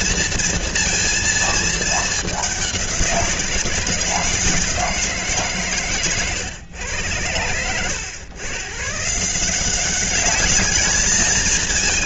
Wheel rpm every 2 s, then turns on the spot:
230, 180, 160, 110, 140, 220.
none